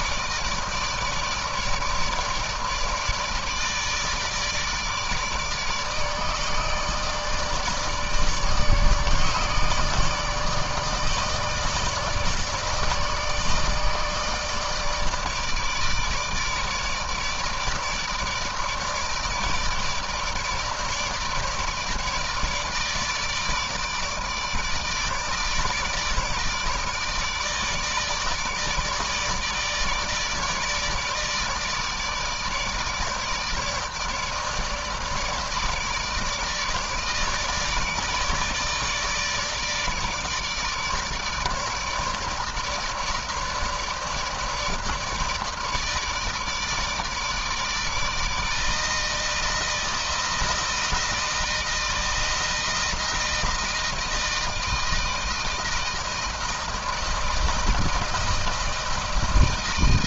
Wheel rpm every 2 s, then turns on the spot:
160, 150, 150, 150, 150, 160, 150, 160, 160, 150, 160, 150, 150, 160, 150, 150, 160, 160, 150, 150, 150, 160, 160, 150, 160, 160, 160, 160, 160, 160.
none